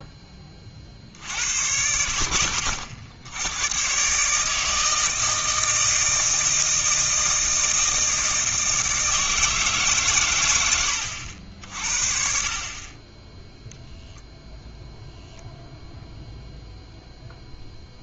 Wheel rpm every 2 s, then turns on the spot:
40, 60, 160, 160, 160, 110, 30, 0, 0.
none